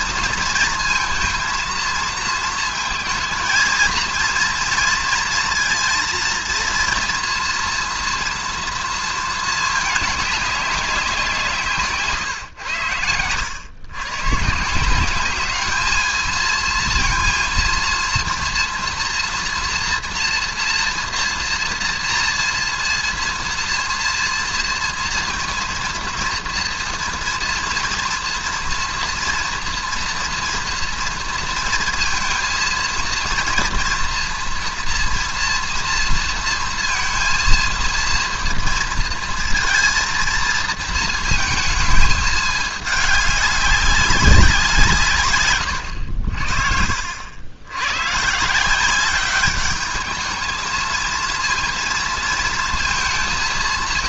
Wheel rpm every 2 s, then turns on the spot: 230, 230, 230, 230, 230, 190, 100, 150, 230, 240, 230, 230, 230, 230, 230, 230, 230, 240, 230, 230, 230, 210, 170, 60, 170, 220, 230.
46-48